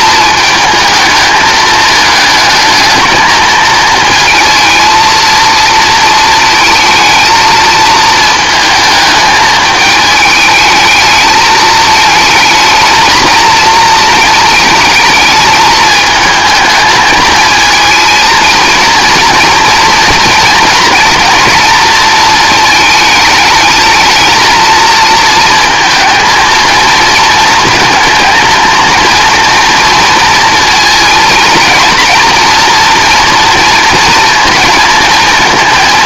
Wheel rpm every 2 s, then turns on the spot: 220, 220, 230, 220, 220, 210, 220, 220, 220, 230, 240, 220, 230, 220, 230, 230, 230, 230.
none